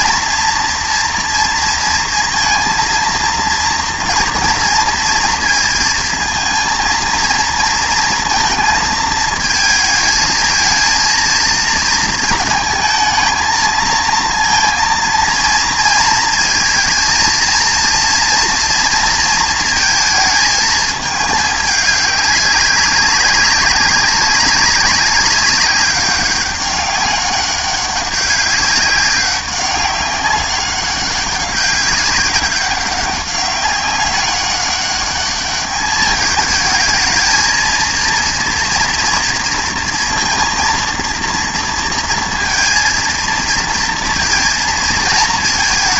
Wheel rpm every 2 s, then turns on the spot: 230, 230, 230, 230, 230, 220, 220, 230, 230, 230, 220, 200, 190, 200, 190, 200, 200, 200, 220, 230, 230, 230, 230.
none